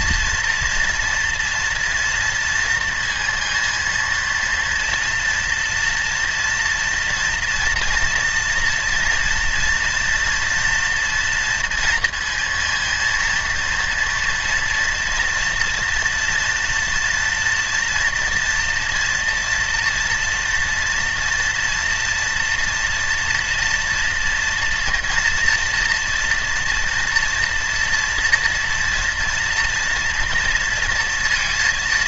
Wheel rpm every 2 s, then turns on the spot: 230, 230, 230, 230, 230, 230, 230, 230, 230, 240, 230, 230, 230, 230, 230, 230.
none